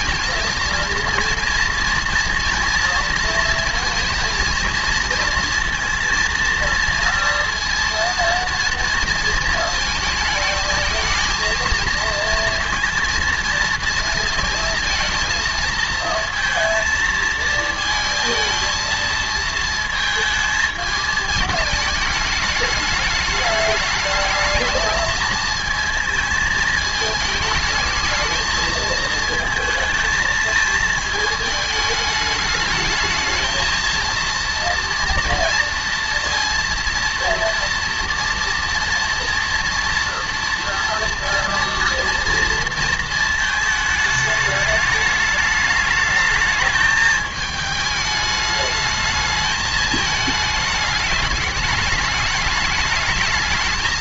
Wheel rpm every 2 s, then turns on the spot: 230, 230, 230, 230, 230, 220, 230, 230, 230, 230, 220, 210, 220, 220, 220, 220, 210, 230, 230, 230, 240, 230, 210, 220, 210, 220, 220.
none